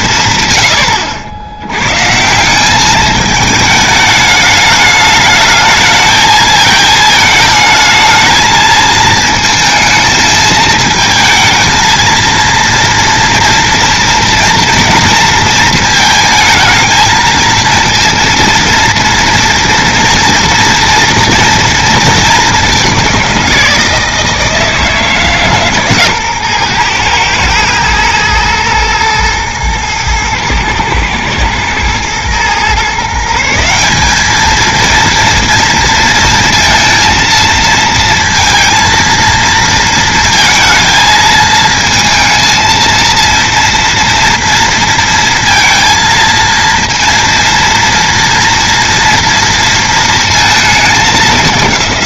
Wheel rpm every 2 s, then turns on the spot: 130, 180, 210, 220, 220, 220, 230, 230, 230, 230, 240, 210, 160, 120, 120, 120, 130, 220, 230, 220, 220, 220, 230, 230, 230, 220.
none